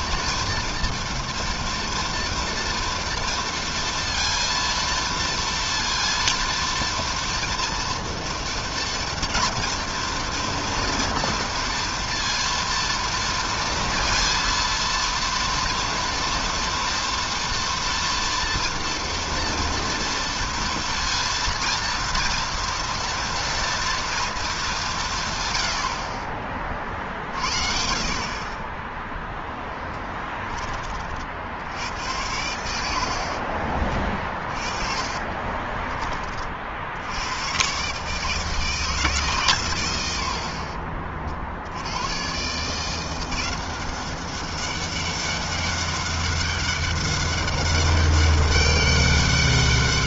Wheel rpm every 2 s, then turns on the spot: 230, 230, 230, 230, 230, 230, 230, 230, 240, 230, 230, 230, 140, 60, 0, 70, 60, 30, 100, 140, 50, 180, 200, 200, 200.
32-36